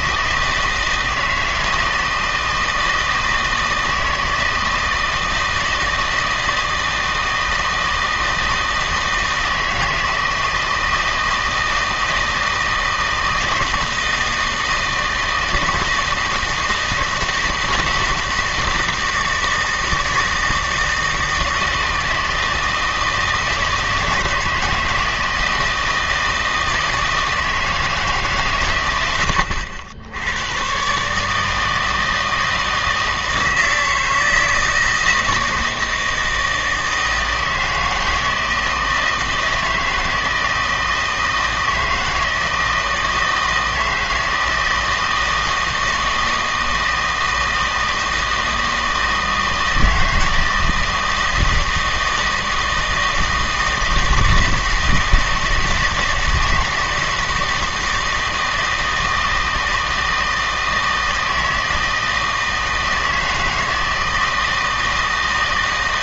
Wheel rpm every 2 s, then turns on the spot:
160, 160, 160, 160, 160, 160, 160, 160, 160, 160, 160, 160, 160, 160, 110, 120, 160, 160, 160, 160, 160, 160, 160, 160, 160, 160, 160, 160, 160, 160, 160, 160, 160.
none